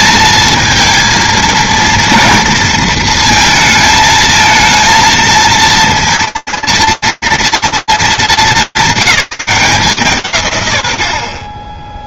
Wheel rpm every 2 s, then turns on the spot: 220, 230, 220, 230, 220, 170.
none